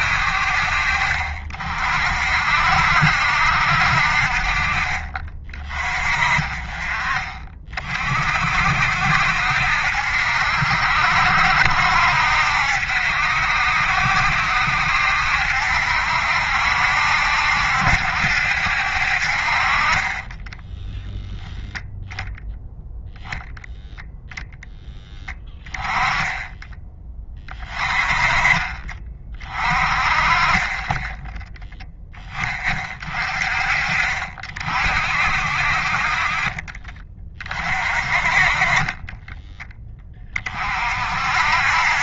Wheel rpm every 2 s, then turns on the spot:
50, 60, 40, 30, 60, 70, 70, 70, 70, 70, 10, 0, 0, 10, 30, 20, 30, 50, 40, 30, 40.
none